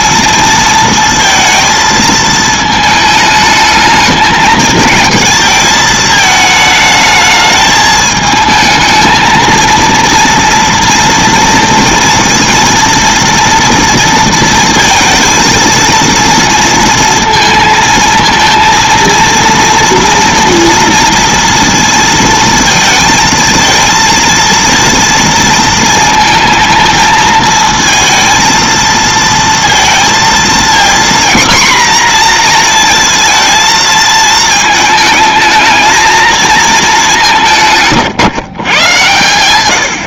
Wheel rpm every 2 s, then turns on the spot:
230, 220, 220, 220, 220, 230, 230, 230, 230, 230, 230, 220, 230, 220, 230, 230, 240, 220, 220, 130.
none